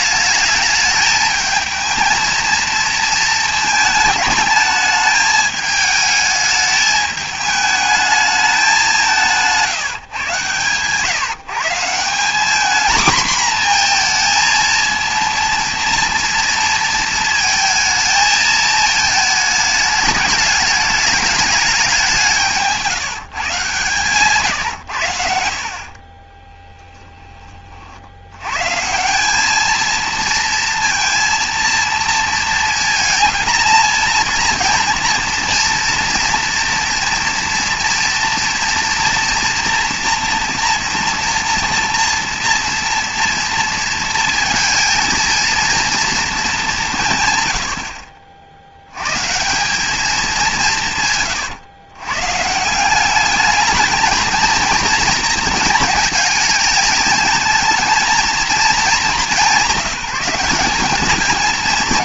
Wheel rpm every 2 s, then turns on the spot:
210, 220, 210, 210, 200, 130, 220, 230, 230, 220, 200, 170, 120, 10, 160, 230, 230, 230, 240, 230, 230, 230, 220, 170, 70, 160, 170, 230, 210, 220, 190.
none